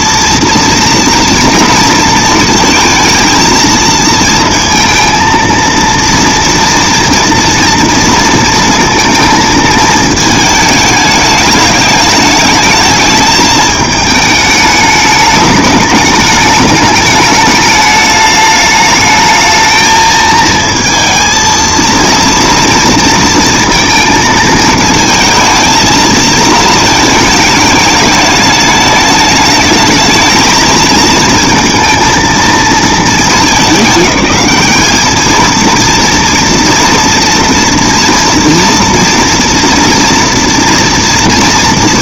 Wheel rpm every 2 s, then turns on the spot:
230, 230, 230, 230, 220, 210, 210, 220, 210, 220, 230, 220, 220, 210, 220, 230, 200, 230, 230, 230, 230.
none